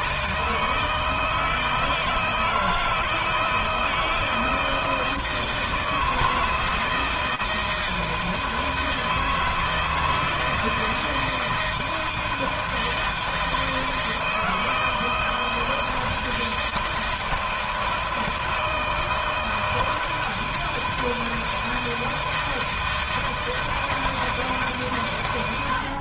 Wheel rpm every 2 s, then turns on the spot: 160, 160, 160, 160, 160, 160, 160, 160, 160, 160, 160, 160, 140.
none